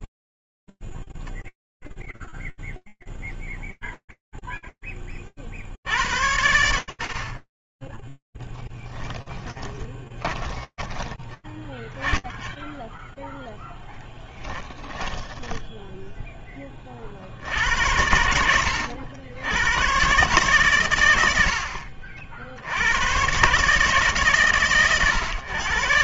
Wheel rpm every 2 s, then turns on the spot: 0, 0, 0, 90, 20, 20, 10, 0, 10, 80, 140, 50, 150.
10-12 16-18